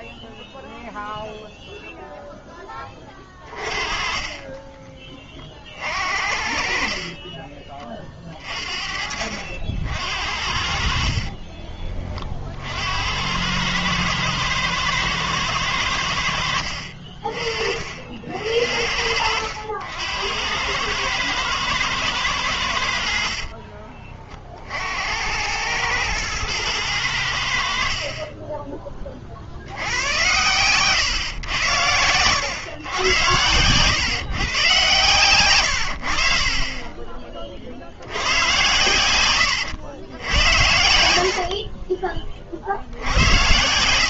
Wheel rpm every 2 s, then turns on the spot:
0, 10, 30, 50, 40, 50, 50, 110, 70, 60, 100, 90, 50, 110, 30, 120, 110, 130, 40, 100, 80, 50.
16-18 28-32